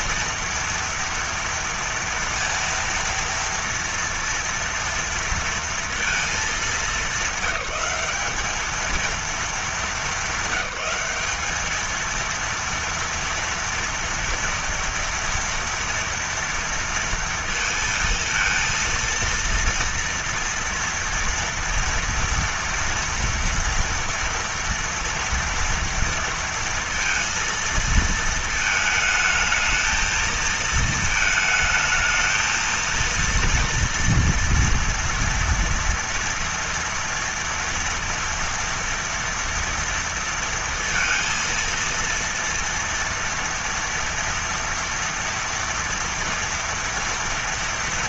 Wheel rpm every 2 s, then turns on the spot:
230, 230, 230, 210, 210, 200, 230, 230, 230, 230, 230, 230, 230, 230, 220, 220, 230, 230, 230, 230, 230, 230, 240, 230.
none